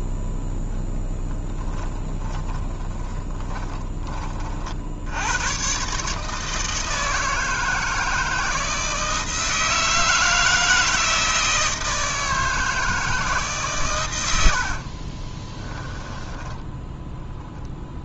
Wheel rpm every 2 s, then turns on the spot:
10, 20, 70, 160, 160, 160, 160, 60, 10.
2-4 14-18